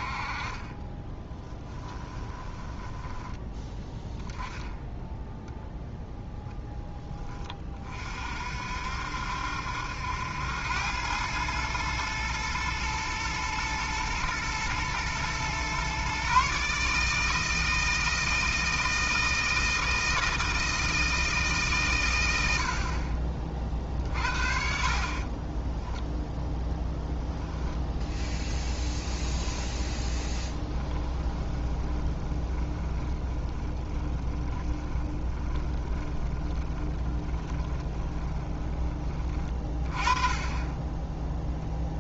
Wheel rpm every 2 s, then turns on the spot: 20, 10, 10, 10, 60, 100, 110, 120, 150, 160, 160, 50, 50, 10, 10, 20, 20, 20, 20, 20, 10.
0-2 28-38